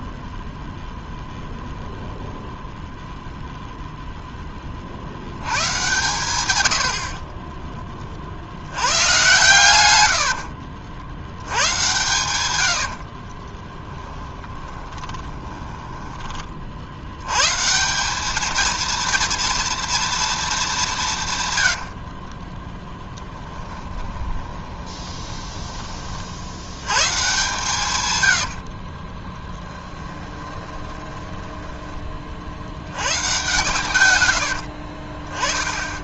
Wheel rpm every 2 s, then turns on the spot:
0, 0, 30, 100, 90, 60, 90, 10, 50, 220, 200, 10, 20, 100, 40, 20, 80, 60.
14-16 22-26 28-32 34-36